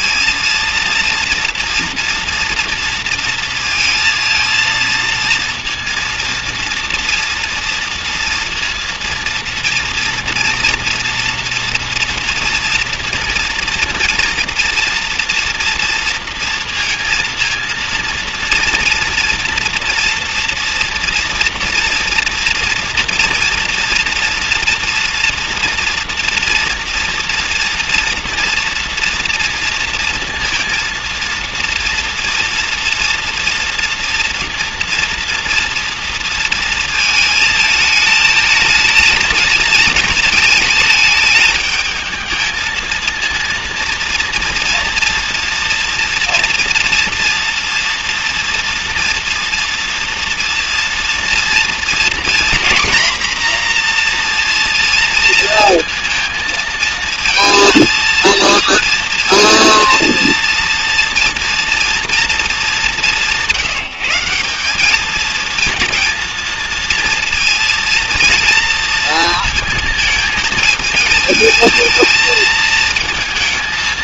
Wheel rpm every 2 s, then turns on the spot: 230, 230, 230, 230, 230, 230, 230, 230, 230, 230, 230, 230, 230, 240, 230, 230, 230, 230, 220, 220, 220, 220, 230, 230, 240, 240, 240, 240, 220, 230, 230, 210, 190, 230, 230, 220, 220.
none